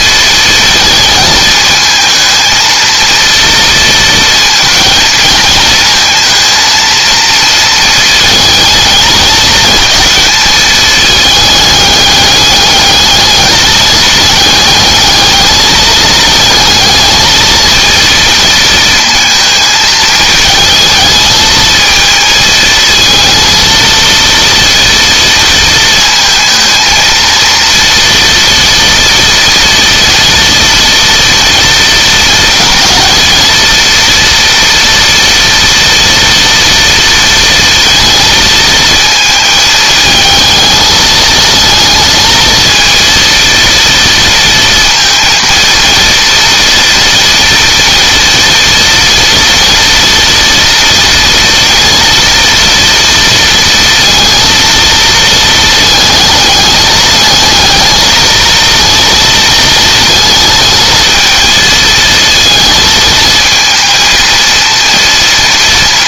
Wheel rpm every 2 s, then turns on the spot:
220, 230, 220, 230, 220, 220, 210, 220, 220, 230, 220, 220, 230, 230, 230, 230, 230, 230, 230, 220, 220, 230, 230, 230, 230, 230, 230, 230, 220, 230, 220, 220, 230.
none